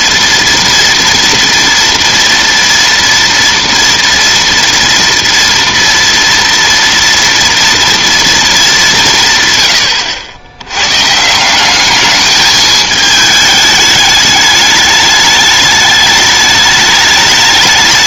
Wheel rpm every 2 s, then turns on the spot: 230, 230, 230, 230, 210, 90, 210, 210, 210.
none